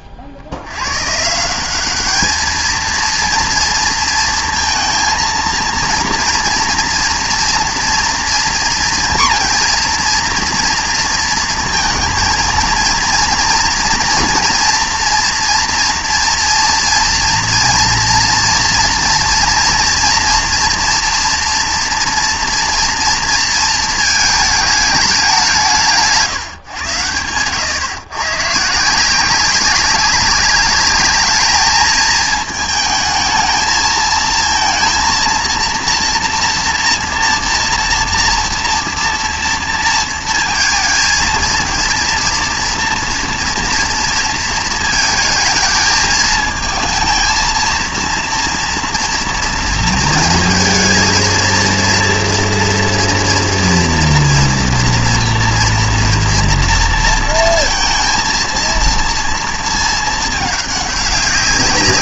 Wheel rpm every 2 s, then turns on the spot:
50, 220, 230, 230, 230, 230, 230, 230, 230, 230, 230, 230, 210, 130, 150, 200, 220, 230, 240, 230, 230, 230, 220, 220, 230, 230, 230, 230, 230, 230, 210.
none